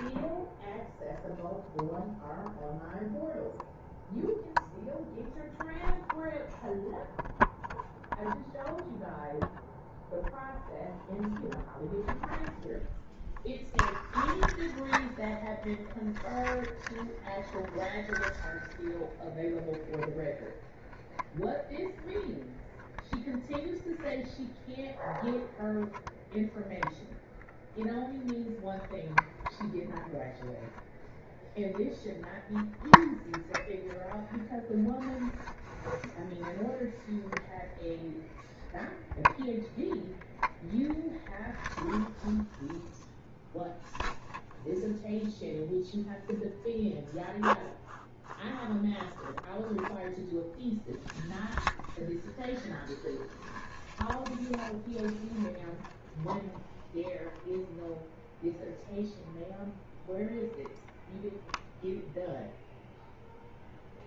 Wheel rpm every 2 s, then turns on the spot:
0, 0, 0, 0, 0, 0, 0, 0, 0, 0, 0, 0, 0, 0, 0, 0, 0, 0, 0, 0, 0, 0, 0, 0, 0, 0, 0, 0, 0, 0, 0, 0.
none